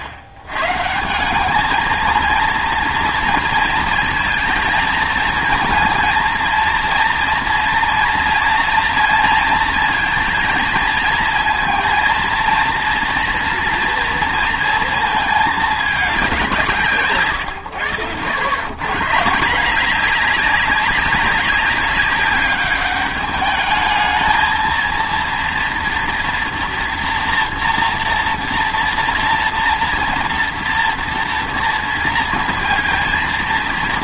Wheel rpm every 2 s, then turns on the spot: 120, 230, 220, 230, 230, 230, 230, 220, 170, 130, 200, 210, 230, 240, 230, 230, 230.
none